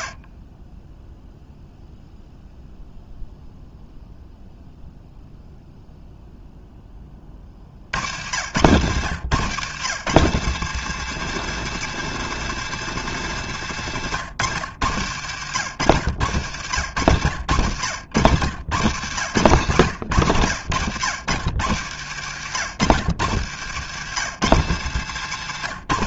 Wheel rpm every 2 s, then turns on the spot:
0, 0, 0, 20, 130, 180, 170, 110, 90, 110, 110, 120, 140.
24-26